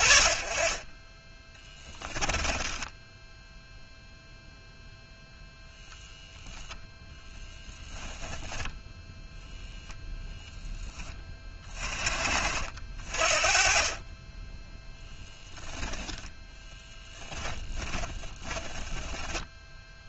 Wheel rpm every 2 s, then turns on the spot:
20, 10, 0, 10, 0, 10, 40, 10, 10, 10.
2-4 16-20